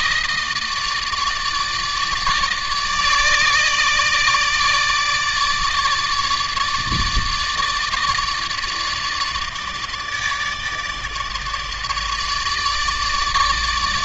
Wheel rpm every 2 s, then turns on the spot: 160, 150, 150, 150, 150, 150, 150.
none